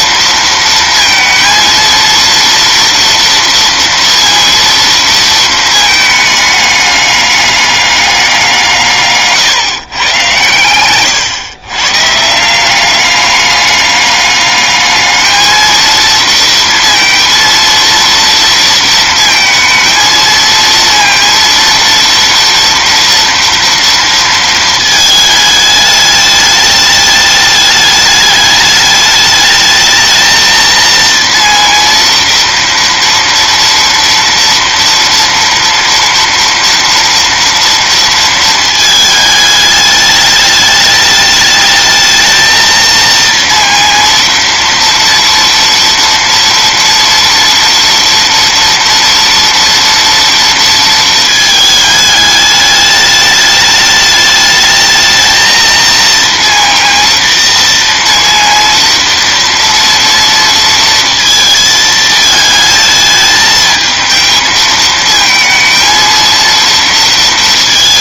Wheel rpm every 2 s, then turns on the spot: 230, 230, 230, 210, 170, 120, 170, 210, 230, 230, 230, 230, 220, 210, 210, 230, 230, 230, 240, 220, 210, 230, 230, 230, 240, 230, 210, 220, 230, 230, 230, 220, 220, 230.
none